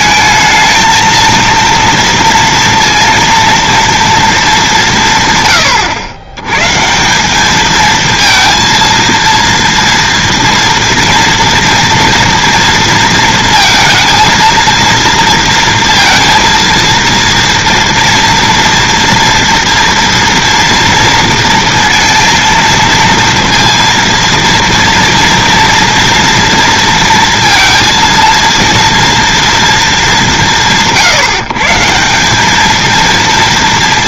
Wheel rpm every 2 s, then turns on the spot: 220, 230, 200, 120, 230, 230, 230, 230, 230, 230, 230, 230, 230, 230, 230, 170, 200.
none